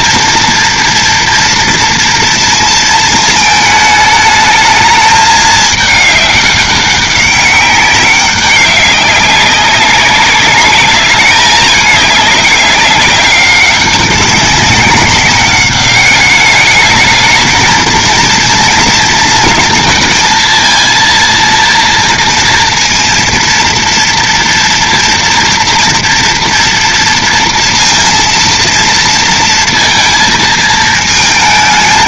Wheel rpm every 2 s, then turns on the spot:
230, 230, 210, 200, 200, 210, 200, 190, 210, 230, 230, 230, 230, 230, 230, 220.
none